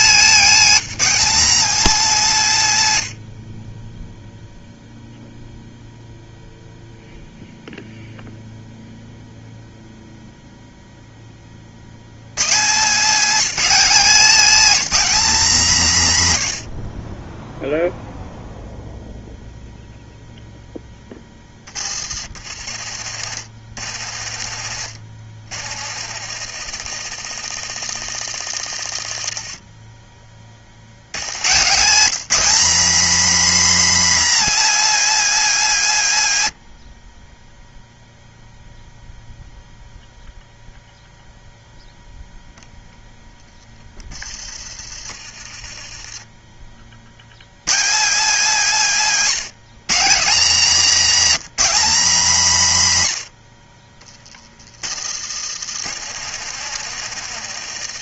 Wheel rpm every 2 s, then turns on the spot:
260, 120, 0, 0, 0, 10, 200, 260, 50, 0, 10, 70, 70, 100, 60, 90, 270, 290, 30, 0, 0, 0, 30, 70, 190, 250, 150, 60, 110.
22-30 56-58